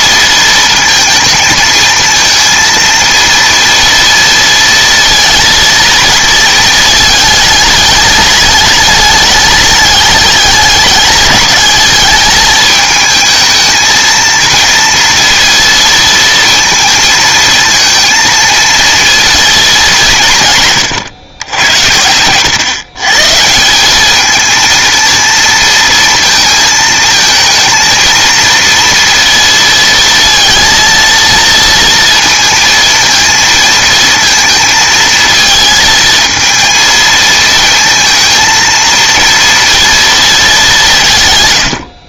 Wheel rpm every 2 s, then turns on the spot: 230, 230, 230, 220, 210, 210, 220, 230, 230, 230, 140, 120, 230, 230, 230, 230, 230, 220, 230, 230, 200.
none